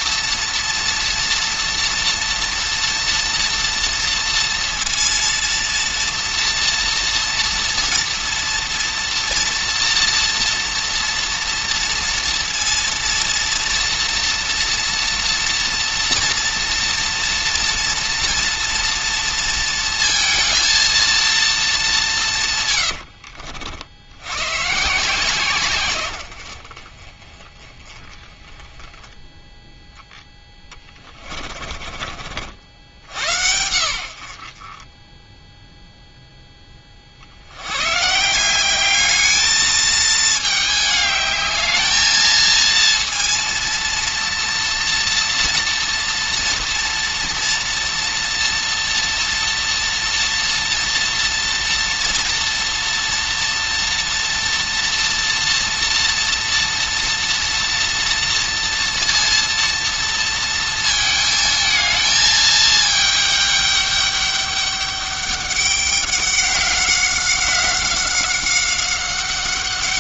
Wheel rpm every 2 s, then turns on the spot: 230, 230, 230, 230, 230, 230, 230, 240, 230, 230, 230, 110, 140, 40, 10, 20, 80, 30, 20, 200, 210, 230, 230, 230, 240, 230, 230, 240, 230, 230, 230, 220, 200, 190, 190.
30-32